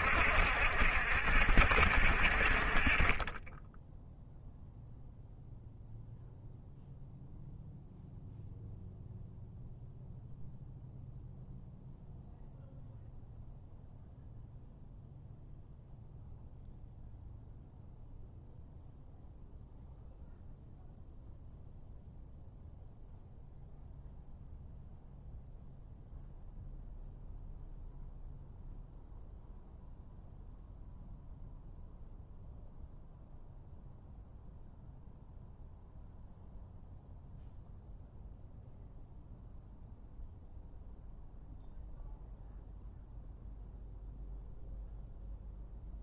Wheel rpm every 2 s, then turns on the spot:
70, 40, 0, 0, 0, 0, 0, 0, 0, 0, 0, 0, 0, 0, 0, 0, 0, 0, 0, 0, 0, 0, 0.
none